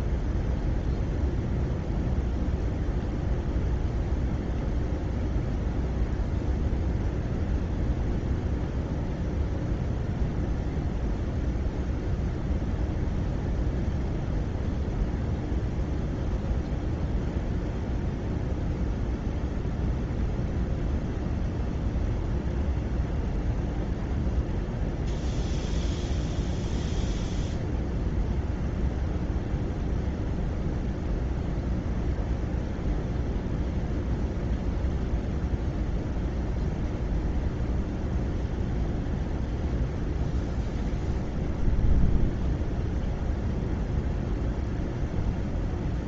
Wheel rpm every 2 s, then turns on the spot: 0, 0, 0, 0, 0, 0, 0, 0, 0, 0, 0, 0, 0, 0, 0, 0, 0, 0, 0, 0, 0, 0, 0.
none